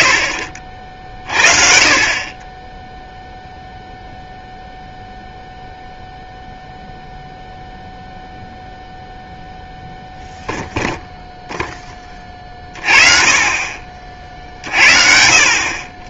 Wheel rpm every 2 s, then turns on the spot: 30, 20, 0, 0, 0, 0, 40, 50.
none